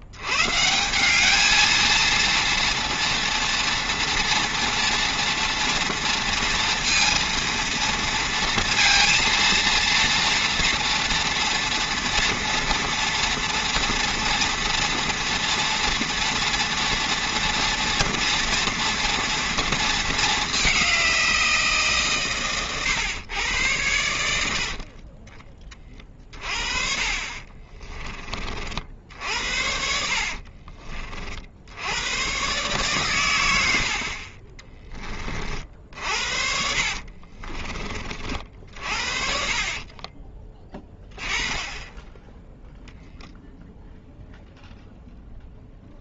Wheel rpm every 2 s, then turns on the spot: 90, 230, 230, 230, 230, 230, 230, 230, 240, 230, 210, 130, 80, 30, 40, 70, 120, 40, 70, 50, 20, 10, 0.
30-32 36-38